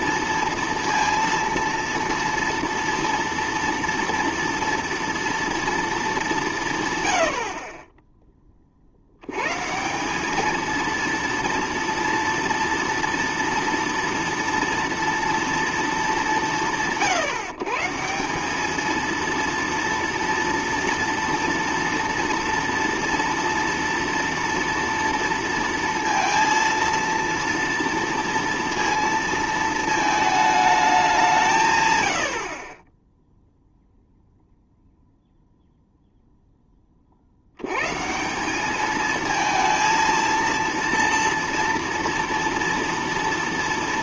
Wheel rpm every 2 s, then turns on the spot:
230, 230, 230, 180, 20, 210, 230, 230, 130, 200, 230, 230, 230, 230, 230, 210, 50, 0, 10, 190, 230, 230.
none